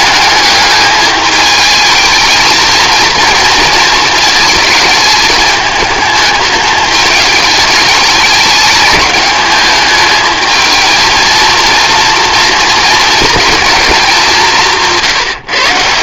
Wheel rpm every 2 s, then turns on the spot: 210, 230, 220, 210, 210, 220, 230, 170.
none